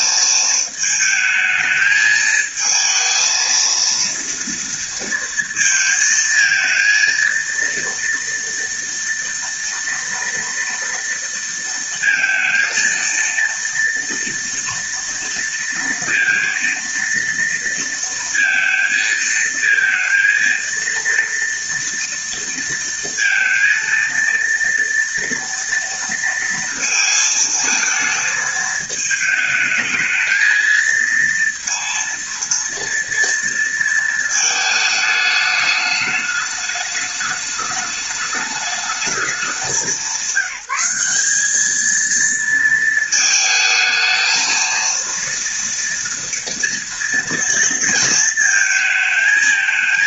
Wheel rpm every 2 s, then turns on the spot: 220, 230, 230, 230, 230, 230, 230, 230, 230, 230, 230, 230, 230, 220, 210, 230, 230, 210, 210, 200, 200, 220, 230, 230, 220.
none